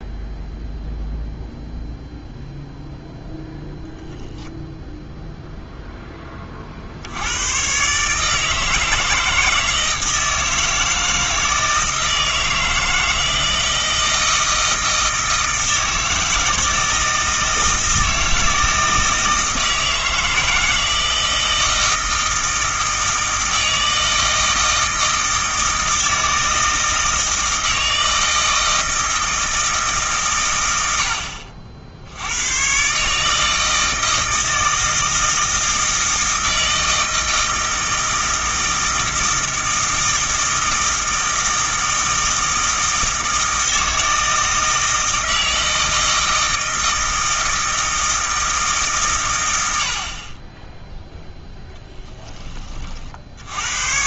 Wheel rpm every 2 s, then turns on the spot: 0, 0, 0, 50, 160, 160, 160, 160, 160, 160, 160, 160, 160, 160, 160, 110, 120, 160, 160, 160, 160, 160, 160, 160, 150, 10, 40.
none